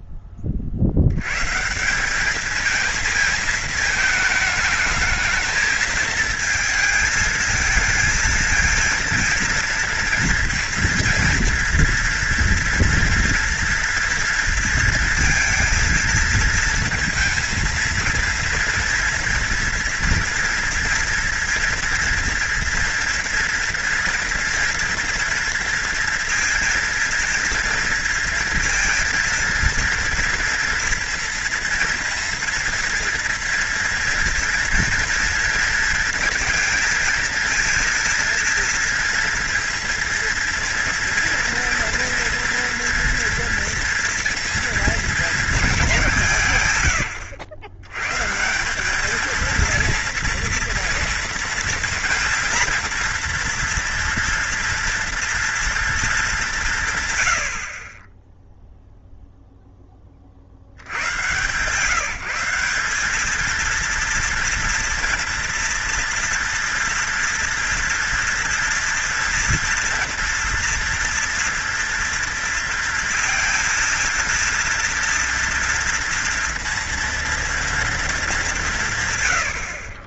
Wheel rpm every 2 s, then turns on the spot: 20, 210, 220, 220, 230, 230, 230, 230, 220, 230, 230, 230, 230, 230, 230, 230, 230, 230, 230, 230, 230, 230, 230, 170, 160, 230, 230, 230, 190, 0, 50, 170, 230, 240, 230, 230, 230, 230, 230, 200.
none